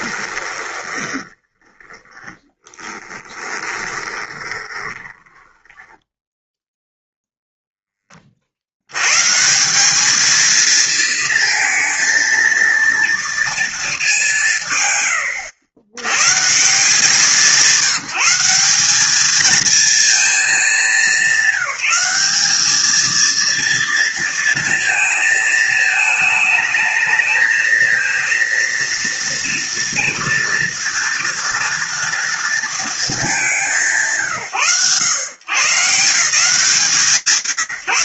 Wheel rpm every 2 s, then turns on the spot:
20, 10, 20, 0, 90, 220, 230, 120, 160, 200, 200, 220, 230, 220, 230, 230, 220, 120, 170.
0-6